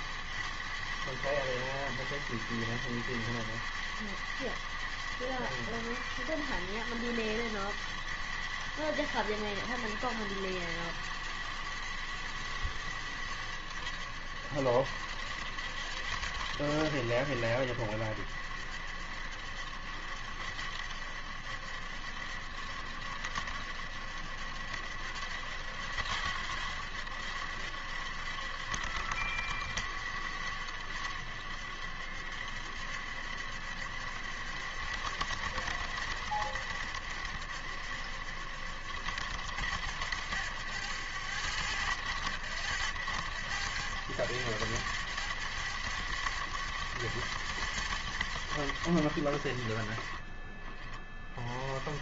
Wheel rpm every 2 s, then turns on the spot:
100, 100, 100, 100, 100, 100, 90, 80, 90, 70, 70, 70, 70, 70, 70, 80, 70, 80, 80, 70, 80, 80, 80, 80, 80, 30.
none